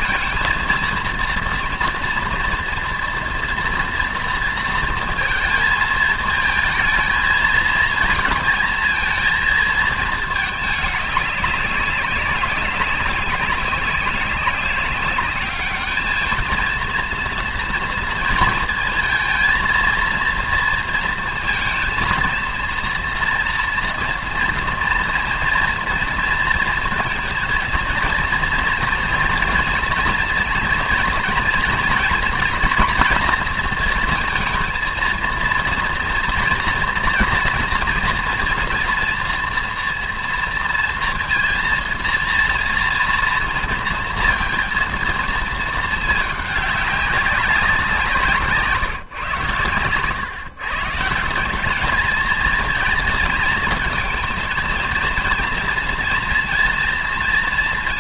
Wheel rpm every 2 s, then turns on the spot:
230, 230, 230, 220, 220, 210, 200, 200, 230, 230, 230, 230, 230, 230, 230, 230, 230, 230, 230, 240, 230, 230, 230, 200, 160, 160, 230, 230, 230.
none